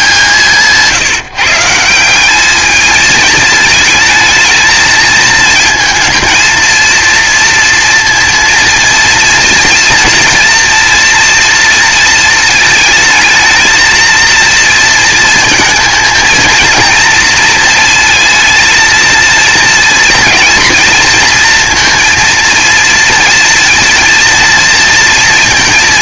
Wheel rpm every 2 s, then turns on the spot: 150, 220, 220, 230, 230, 230, 220, 230, 230, 230, 230, 230, 230.
none